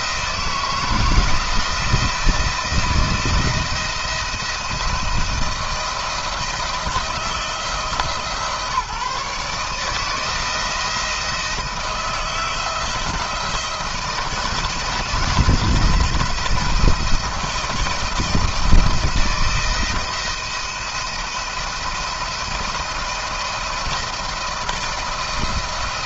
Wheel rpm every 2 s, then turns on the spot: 160, 170, 170, 160, 150, 170, 160, 160, 170, 160, 170, 170, 170.
none